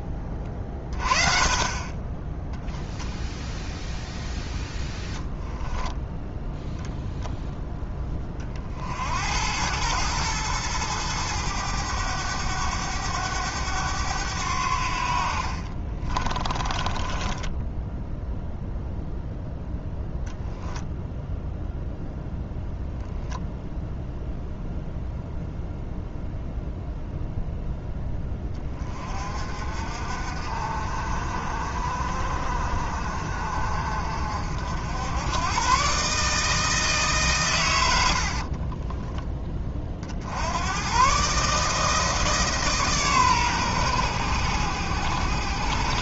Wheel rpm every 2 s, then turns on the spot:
30, 0, 0, 0, 50, 110, 100, 70, 20, 0, 0, 0, 0, 0, 30, 50, 50, 80, 150, 20, 110, 140, 80.
16-18 38-40